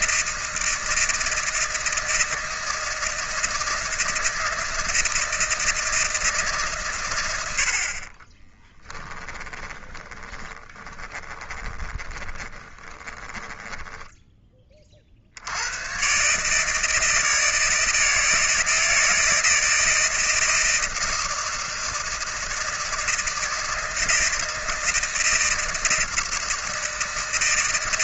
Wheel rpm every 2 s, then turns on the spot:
160, 160, 160, 130, 10, 30, 30, 30, 150, 160, 160, 160, 160, 160.
8-14